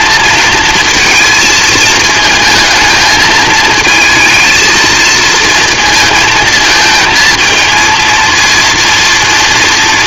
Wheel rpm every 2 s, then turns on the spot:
230, 220, 220, 220, 230.
none